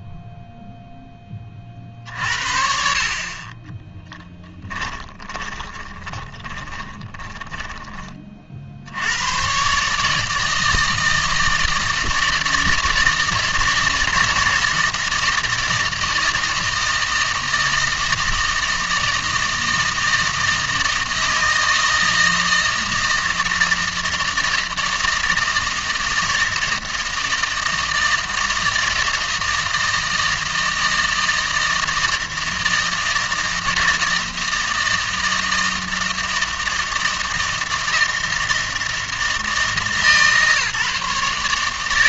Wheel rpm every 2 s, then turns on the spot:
0, 60, 20, 20, 50, 160, 160, 160, 160, 160, 160, 160, 160, 160, 160, 160, 160, 160, 160, 160, 150.
4-8